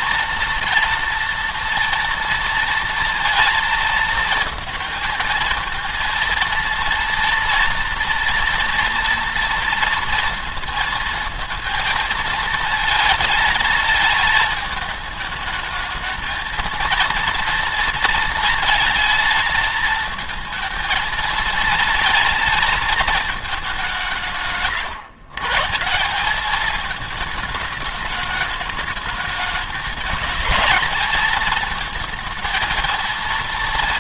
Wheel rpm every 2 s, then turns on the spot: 230, 230, 230, 230, 230, 230, 230, 220, 230, 230, 220, 230, 160, 200, 210, 210, 230.
none